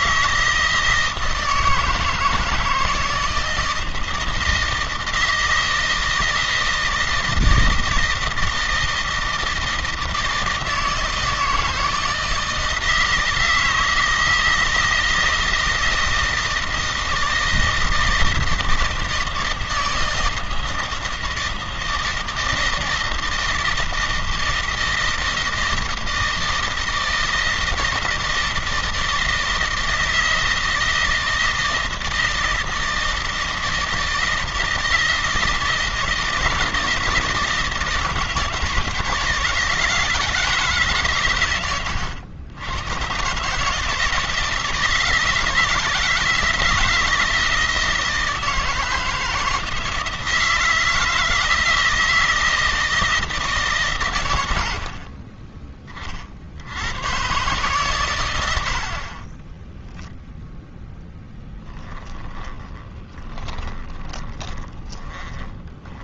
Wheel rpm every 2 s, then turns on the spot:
160, 160, 160, 160, 160, 160, 160, 160, 160, 160, 160, 170, 160, 160, 160, 160, 160, 160, 170, 160, 150, 90, 160, 160, 160, 160, 160, 80, 90, 50, 10, 30, 20.
60-66